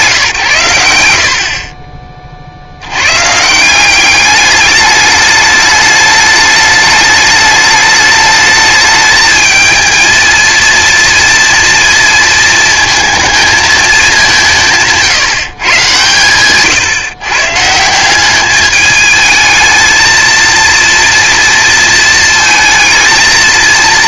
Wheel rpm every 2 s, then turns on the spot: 140, 70, 210, 210, 210, 230, 220, 160, 120, 200, 230, 230.
none